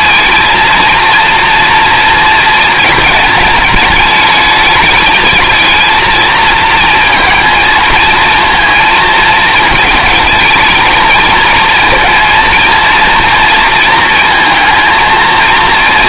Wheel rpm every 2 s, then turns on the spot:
230, 230, 210, 230, 230, 220, 230, 230.
none